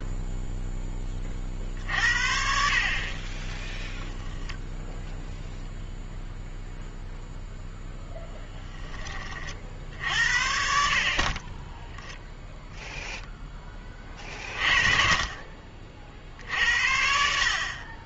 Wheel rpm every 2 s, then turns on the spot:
10, 50, 0, 0, 10, 60, 0, 40, 60.
none